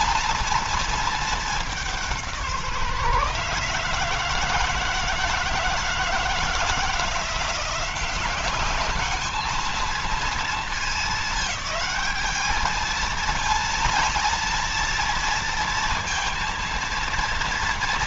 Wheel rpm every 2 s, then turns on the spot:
220, 150, 160, 170, 210, 220, 220, 230, 230.
none